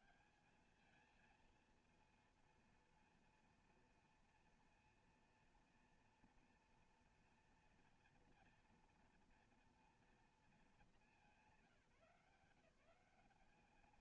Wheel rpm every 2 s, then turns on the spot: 210, 230, 230, 240, 230, 220, 170.
none